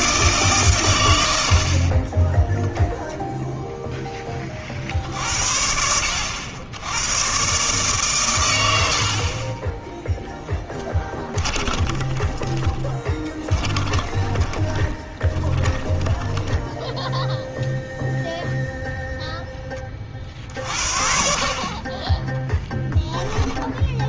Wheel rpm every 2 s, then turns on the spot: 130, 0, 50, 90, 90, 10, 20, 20, 10, 0, 60, 0.
10-18